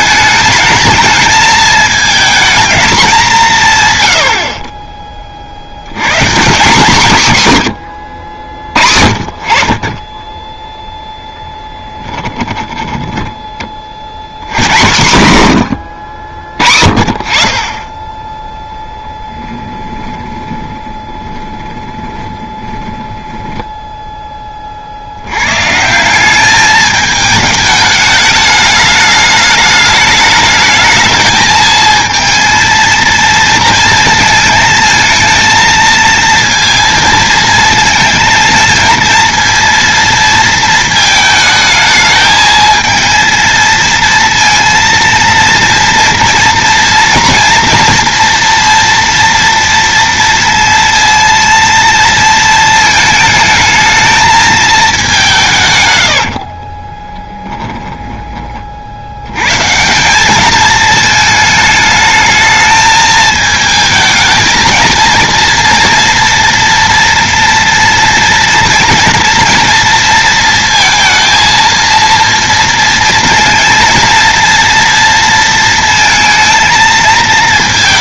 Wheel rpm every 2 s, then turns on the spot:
220, 220, 40, 160, 60, 10, 10, 120, 40, 10, 10, 10, 40, 210, 210, 210, 230, 220, 230, 220, 220, 220, 230, 230, 230, 230, 220, 220, 30, 40, 210, 220, 230, 240, 230, 230, 230, 230, 220.
12-14 20-24 56-58